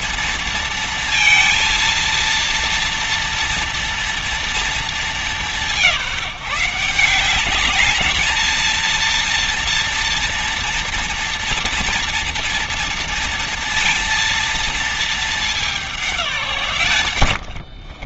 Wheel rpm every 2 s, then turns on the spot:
230, 230, 220, 170, 220, 230, 230, 230, 150.
none